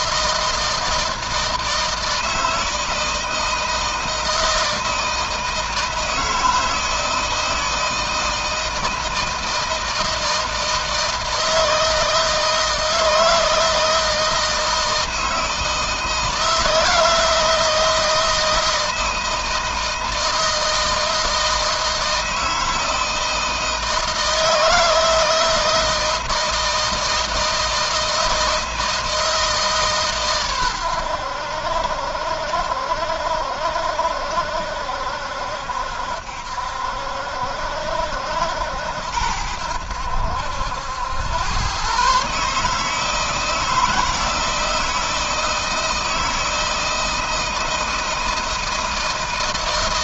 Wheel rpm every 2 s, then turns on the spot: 160, 160, 160, 160, 160, 160, 160, 160, 160, 160, 160, 160, 160, 160, 160, 100, 60, 70, 70, 80, 80, 150, 160, 160, 160.
none